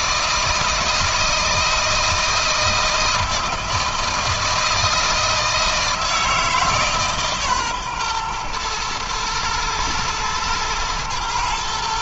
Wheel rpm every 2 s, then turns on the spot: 160, 160, 160, 150, 110, 120.
none